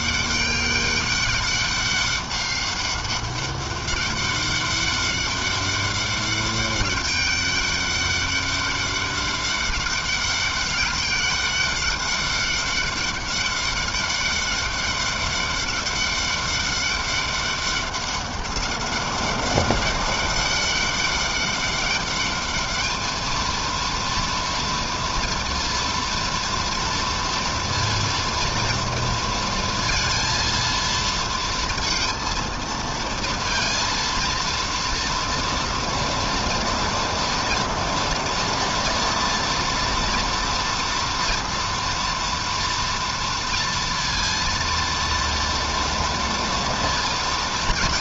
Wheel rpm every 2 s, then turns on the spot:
200, 200, 200, 200, 200, 200, 200, 200, 200, 200, 190, 220, 230, 230, 230, 230, 230, 230, 230, 230, 230, 230, 230, 230.
none